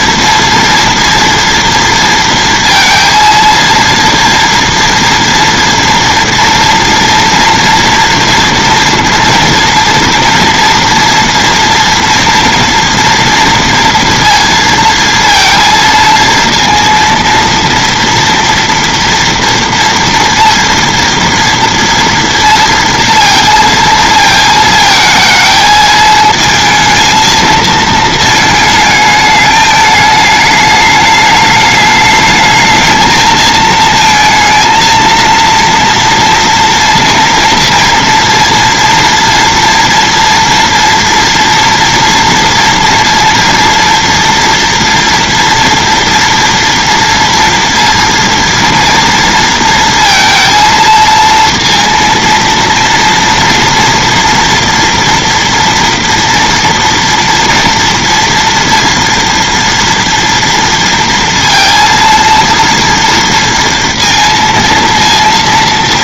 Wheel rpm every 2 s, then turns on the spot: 230, 230, 230, 230, 240, 230, 230, 230, 230, 230, 230, 230, 220, 220, 220, 210, 220, 230, 230, 230, 230, 230, 230, 230, 240, 230, 230, 230, 230, 230, 230, 230, 230.
none